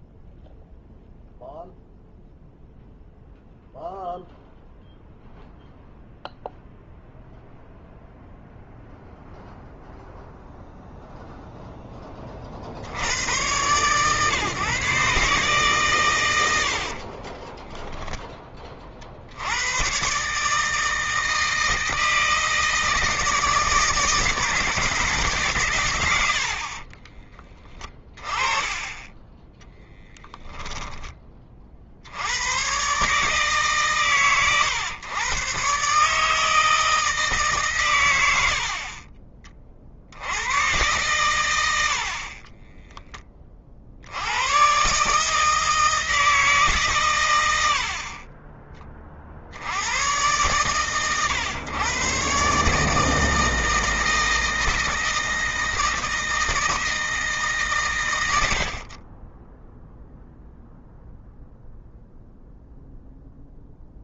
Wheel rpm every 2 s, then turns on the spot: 0, 0, 0, 0, 0, 0, 90, 150, 50, 50, 160, 160, 150, 50, 30, 30, 140, 120, 160, 50, 110, 20, 150, 120, 20, 120, 150, 160, 160, 40, 0, 0.
16-18 26-28